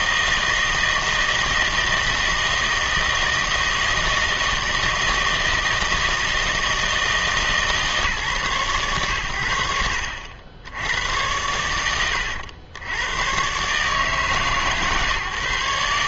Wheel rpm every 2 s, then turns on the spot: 160, 160, 160, 160, 110, 90, 90, 140.
none